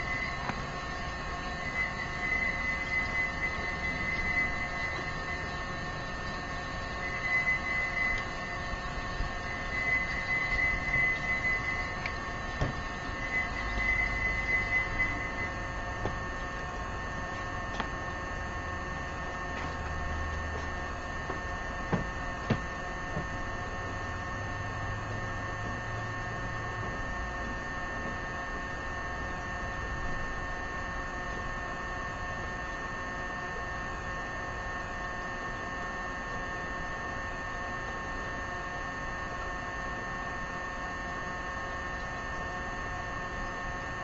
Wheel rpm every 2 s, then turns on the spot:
0, 0, 0, 0, 0, 0, 0, 0, 0, 0, 0, 0, 0, 0, 0, 0, 0, 0, 0, 0, 0, 0.
none